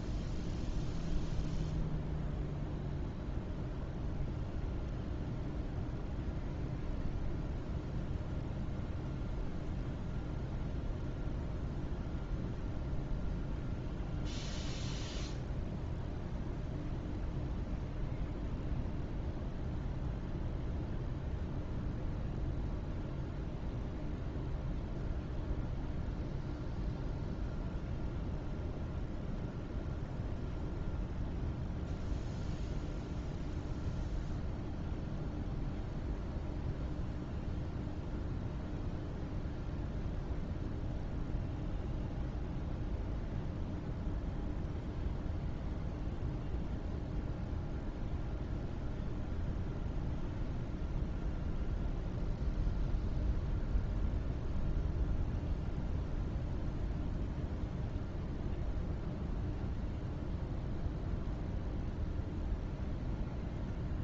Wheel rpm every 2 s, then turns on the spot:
0, 0, 0, 0, 0, 0, 0, 0, 0, 0, 0, 0, 0, 0, 0, 0, 0, 0, 0, 0, 0, 0, 0, 0, 0, 0, 0, 0, 0, 0, 0, 0.
none